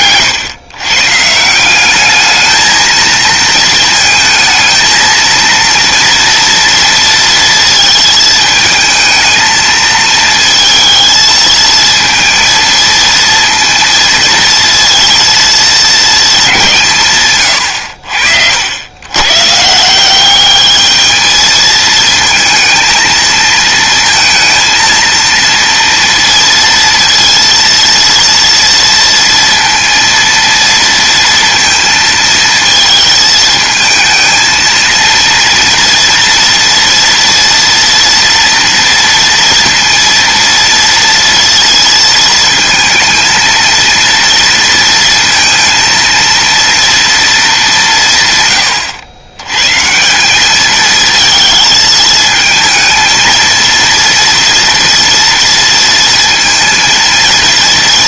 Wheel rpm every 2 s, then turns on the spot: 130, 220, 220, 230, 220, 220, 230, 230, 150, 100, 210, 230, 230, 230, 230, 230, 220, 230, 230, 230, 230, 220, 230, 230, 100, 210, 220, 230, 230.
none